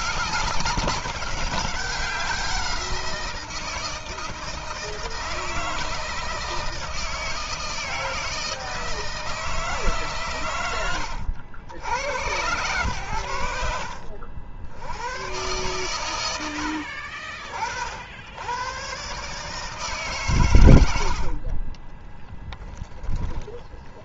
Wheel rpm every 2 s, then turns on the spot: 190, 180, 160, 160, 160, 110, 90, 80, 70, 110, 100, 10.
16-18 22-24